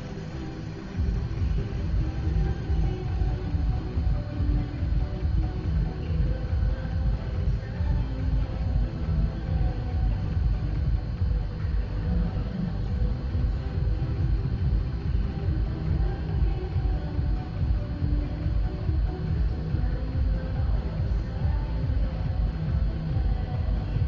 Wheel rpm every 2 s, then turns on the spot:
0, 0, 0, 0, 0, 0, 0, 0, 0, 0, 0, 0.
none